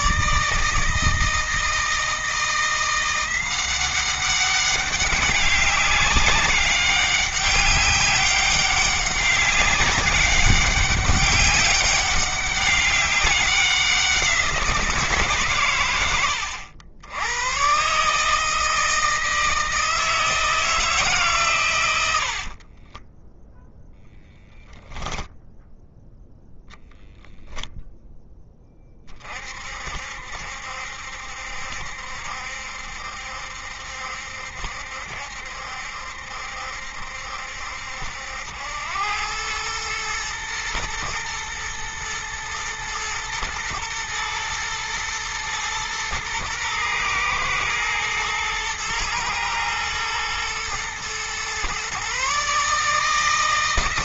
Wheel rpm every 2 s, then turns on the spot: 160, 170, 190, 200, 190, 200, 200, 170, 90, 160, 160, 40, 10, 10, 20, 70, 70, 70, 70, 90, 110, 120, 110, 110, 110, 120, 150.
22-24